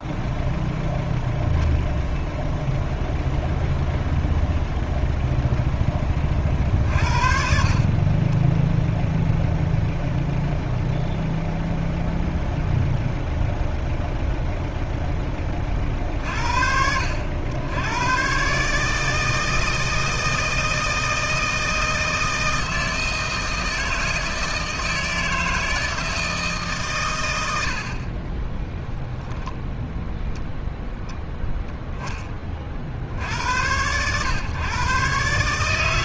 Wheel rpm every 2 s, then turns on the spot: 0, 0, 0, 50, 0, 0, 0, 0, 70, 150, 160, 160, 160, 140, 10, 10, 60, 120.
28-30